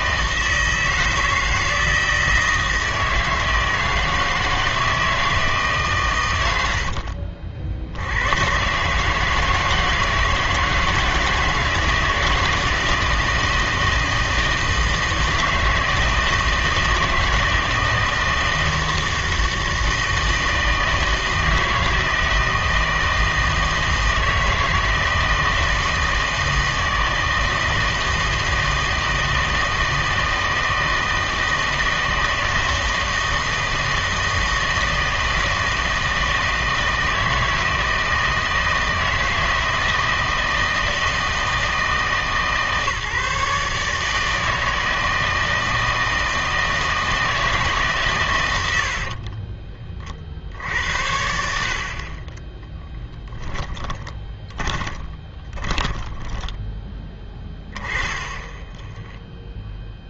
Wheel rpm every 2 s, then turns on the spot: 160, 160, 160, 90, 120, 160, 160, 160, 160, 160, 160, 160, 160, 160, 160, 160, 160, 160, 160, 160, 160, 150, 160, 160, 90, 60, 20, 20, 10, 10.
52-56